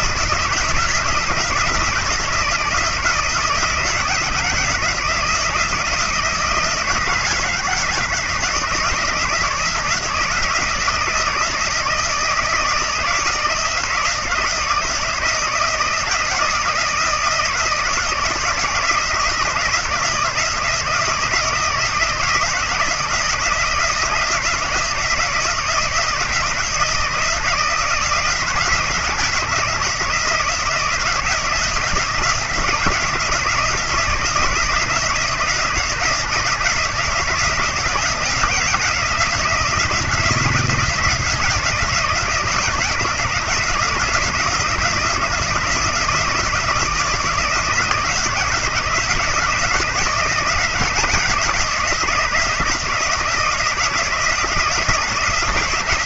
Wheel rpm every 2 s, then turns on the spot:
160, 160, 160, 160, 160, 160, 160, 160, 160, 160, 160, 160, 170, 160, 160, 160, 160, 160, 160, 160, 160, 160, 170, 160, 170, 170, 160, 170.
none